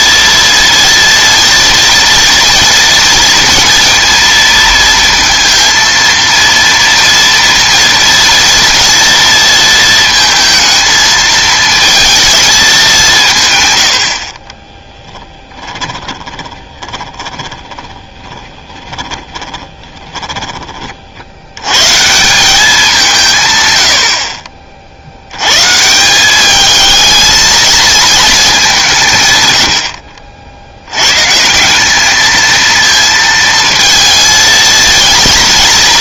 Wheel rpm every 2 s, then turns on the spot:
230, 240, 230, 230, 230, 220, 210, 30, 20, 20, 30, 190, 50, 210, 190, 80, 220, 230.
14-20